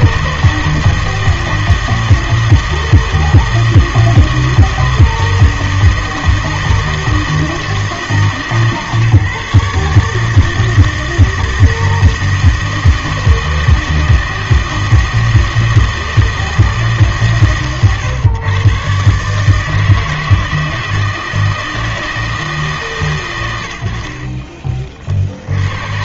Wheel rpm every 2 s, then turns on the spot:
160, 160, 160, 160, 150, 160, 160, 160, 150, 120, 160, 150, 30.
none